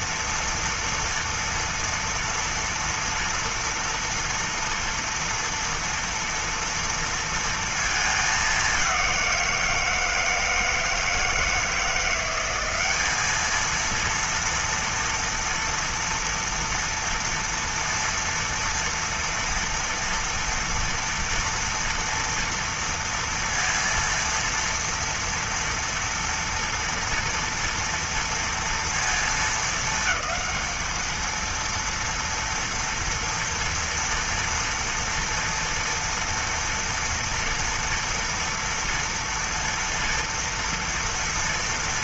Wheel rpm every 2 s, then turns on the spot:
230, 230, 230, 230, 200, 160, 190, 230, 230, 230, 230, 230, 230, 230, 230, 220, 230, 240, 230, 230, 230.
none